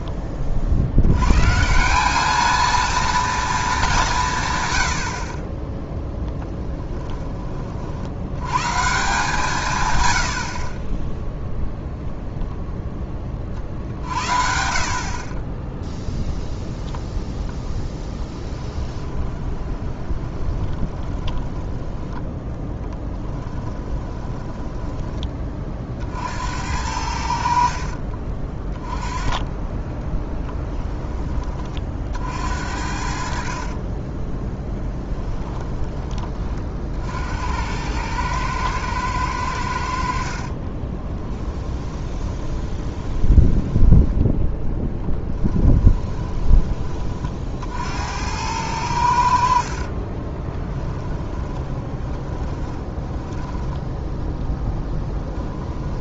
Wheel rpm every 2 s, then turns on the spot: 70, 230, 110, 20, 130, 30, 10, 60, 0, 20, 20, 20, 20, 80, 20, 10, 70, 10, 50, 110, 30, 20, 10, 20, 90, 10, 10, 10.
6-8 18-26 34-36 40-44 50-54